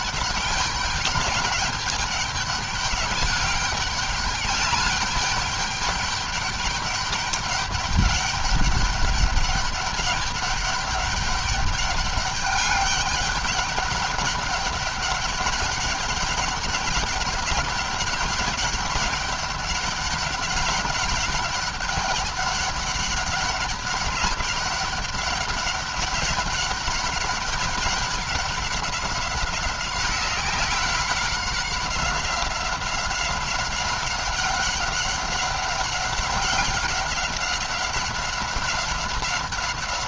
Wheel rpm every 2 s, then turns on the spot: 200, 200, 200, 200, 200, 200, 200, 200, 200, 200, 200, 200, 200, 200, 190, 190, 190, 200, 200, 190.
none